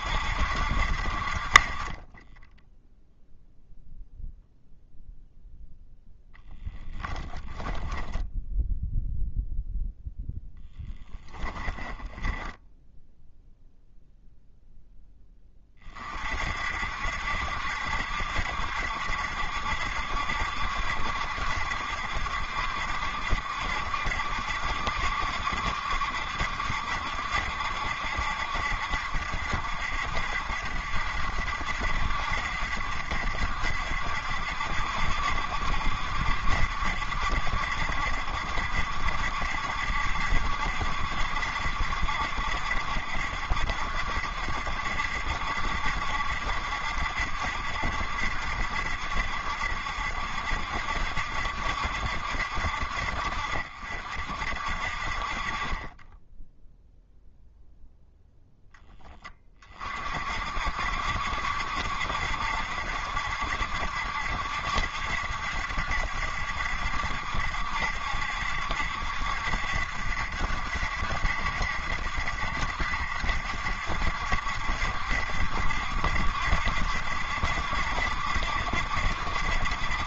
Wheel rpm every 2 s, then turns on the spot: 0, 0, 10, 0, 10, 0, 0, 50, 70, 70, 70, 70, 70, 70, 70, 70, 70, 70, 70, 70, 70, 70, 70, 70, 70, 70, 50, 30, 0, 10, 70, 70, 70, 70, 70, 70, 60, 70, 70, 70.
4-6 8-10